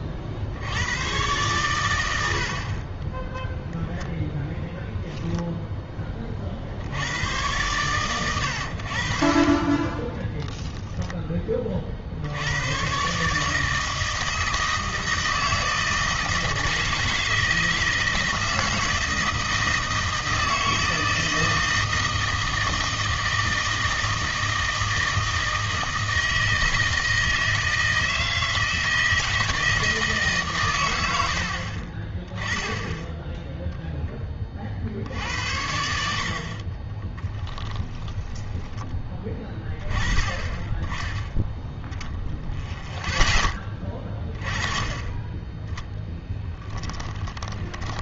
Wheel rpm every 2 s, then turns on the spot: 80, 40, 0, 50, 100, 0, 100, 160, 160, 160, 160, 160, 160, 160, 160, 130, 10, 40, 30, 20, 20, 0, 20, 20.
36-40 46-48